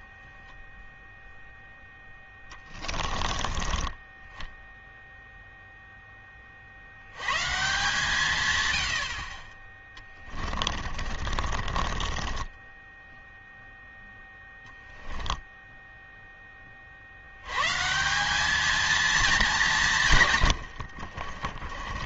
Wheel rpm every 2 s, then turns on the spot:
0, 20, 0, 140, 30, 30, 0, 10, 110, 190, 30.
10-12 20-22